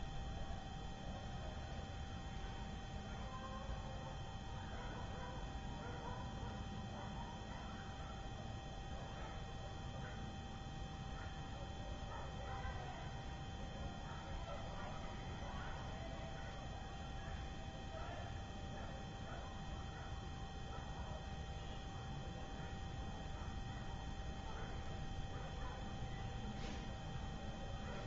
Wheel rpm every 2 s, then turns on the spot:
0, 0, 0, 0, 0, 0, 0, 0, 0, 0, 0, 0, 0, 0.
none